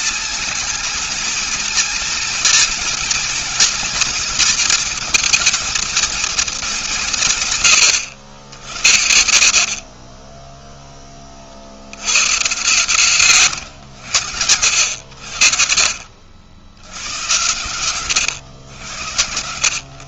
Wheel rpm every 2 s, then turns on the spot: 230, 230, 240, 210, 90, 20, 110, 90, 70, 90.
none